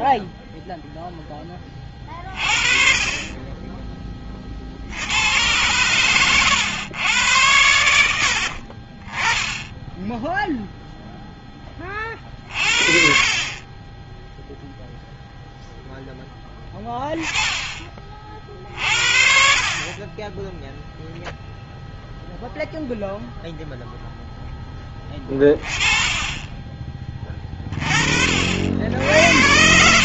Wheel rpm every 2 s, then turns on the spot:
0, 30, 40, 110, 50, 0, 50, 10, 10, 50, 10, 0, 10, 10, 50.
none